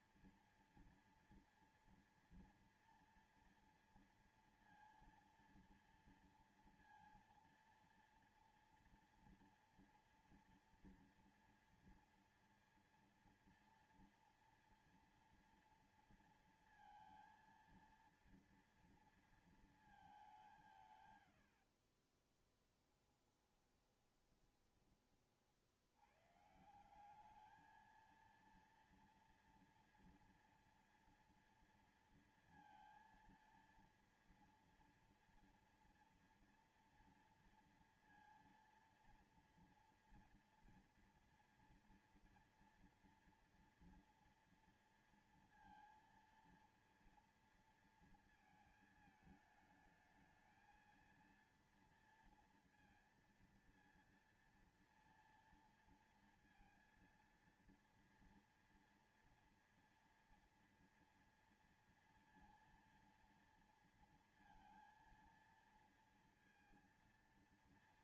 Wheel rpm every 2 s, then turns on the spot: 240, 230, 230, 230, 230, 230, 230, 230, 230, 230, 180, 30, 20, 150, 230, 230, 230, 230, 230, 230, 230, 230, 230, 230, 220, 220, 230, 230, 230, 230, 230, 230, 230, 230.
22-24